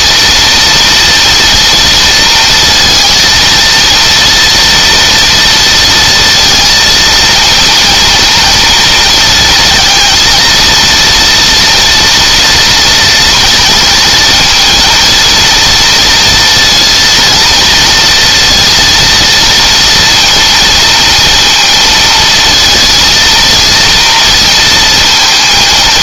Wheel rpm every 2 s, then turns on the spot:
230, 230, 230, 230, 220, 230, 230, 230, 230, 230, 230, 230, 230.
none